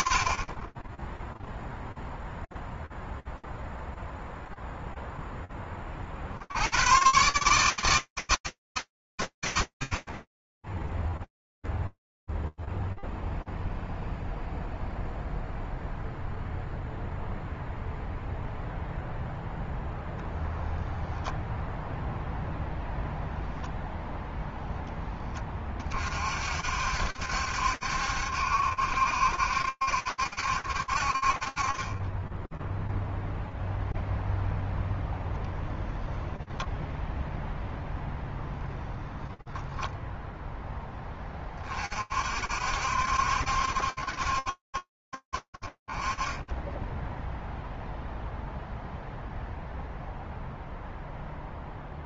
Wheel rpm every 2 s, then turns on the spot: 20, 0, 0, 100, 120, 0, 0, 0, 0, 0, 0, 0, 0, 50, 70, 60, 0, 0, 0, 0, 0, 60, 60, 10, 0, 0.
none